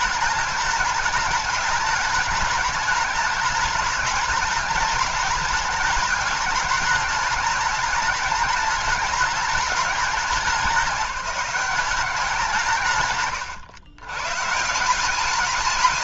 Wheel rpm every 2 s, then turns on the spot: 210, 210, 210, 210, 210, 190, 150, 160.
none